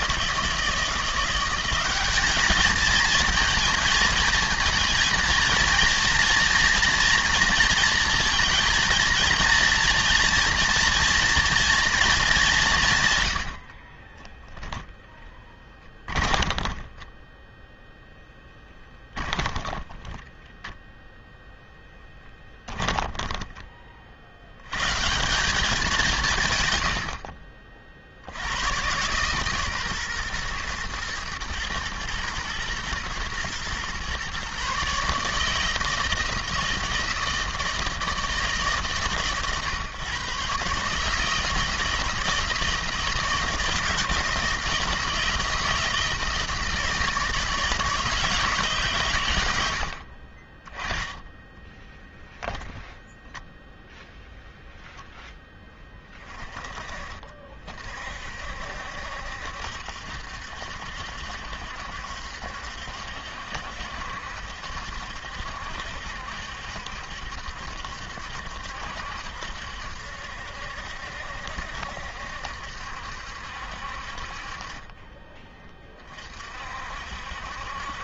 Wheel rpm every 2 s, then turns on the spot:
170, 220, 220, 230, 230, 240, 150, 0, 20, 10, 10, 10, 120, 100, 110, 110, 120, 140, 160, 140, 150, 160, 160, 160, 120, 20, 0, 0, 40, 70, 60, 70, 70, 70, 70, 70, 70, 20, 60.
16-20 22-24